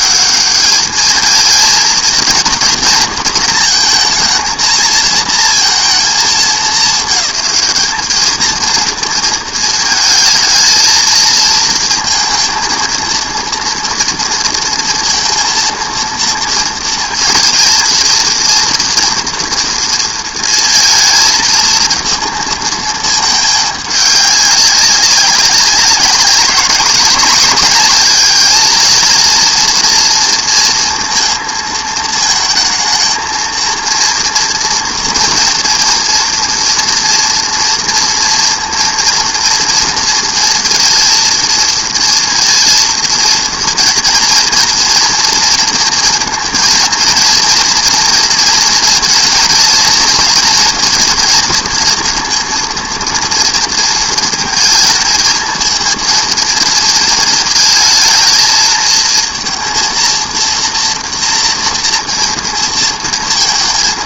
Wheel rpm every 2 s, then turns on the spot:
210, 230, 220, 200, 220, 220, 230, 230, 230, 230, 220, 220, 200, 200, 220, 230, 220, 230, 230, 230, 230, 230, 230, 230, 230, 230, 230, 220, 220, 220, 230, 230.
none